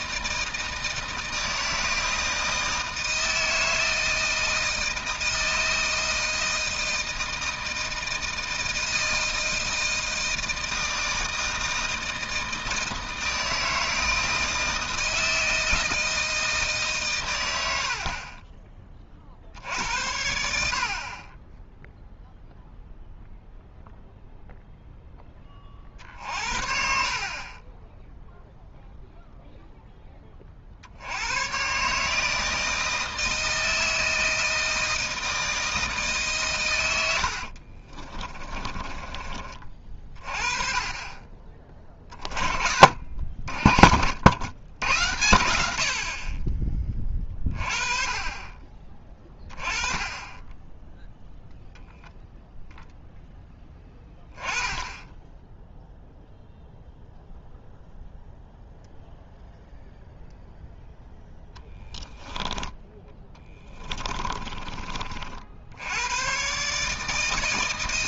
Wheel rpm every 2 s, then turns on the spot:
160, 160, 160, 160, 160, 160, 160, 160, 150, 20, 60, 0, 0, 50, 0, 50, 160, 160, 110, 20, 30, 40, 90, 20, 30, 10, 0, 10, 0, 0, 0, 10, 30, 140.
38-40 62-64